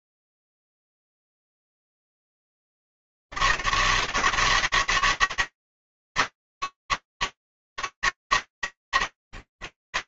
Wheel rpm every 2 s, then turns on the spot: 80, 160, 150, 150, 100.
none